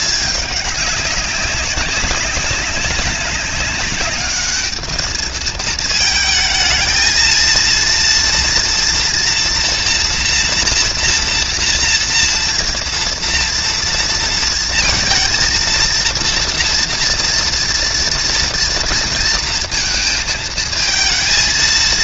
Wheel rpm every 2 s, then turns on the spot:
200, 190, 220, 230, 240, 230, 230, 230, 230, 230, 220.
none